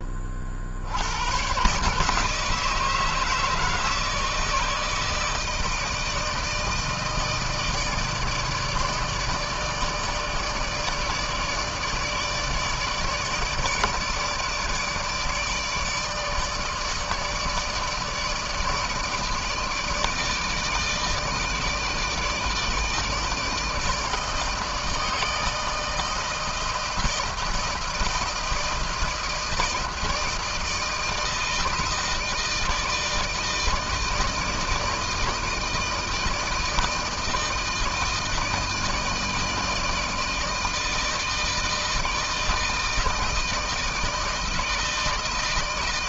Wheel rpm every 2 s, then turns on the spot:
60, 160, 160, 160, 160, 150, 150, 150, 160, 160, 160, 160, 160, 160, 160, 160, 160, 160, 160, 160, 160, 160, 160.
none